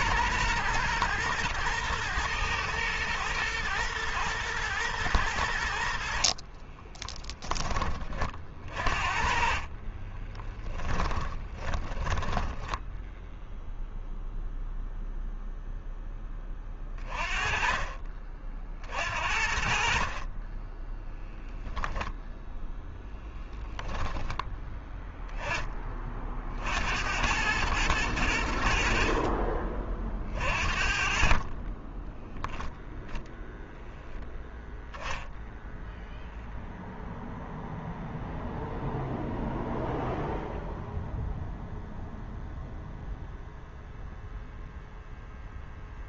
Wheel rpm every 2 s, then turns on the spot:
120, 110, 110, 30, 40, 30, 0, 0, 20, 60, 10, 0, 10, 80, 50, 40, 0, 0, 0, 0, 0, 0, 0.
6-12 20-22